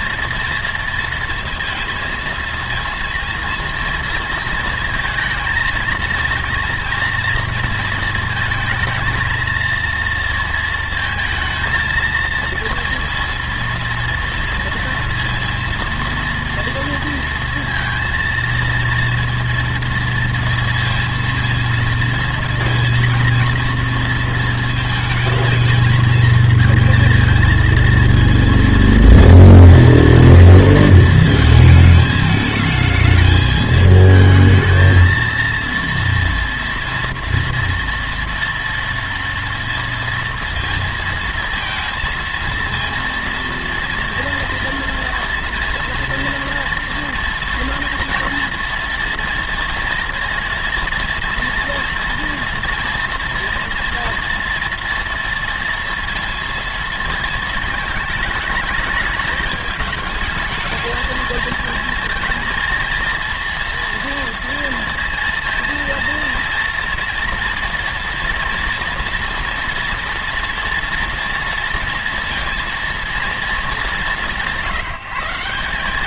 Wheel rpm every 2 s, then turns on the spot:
230, 230, 230, 240, 220, 220, 230, 230, 230, 230, 230, 230, 230, 230, 230, 230, 210, 220, 230, 230, 230, 230, 230, 230, 230, 230, 230, 230, 230, 210, 220, 230, 230, 230, 230, 230, 230, 160.
none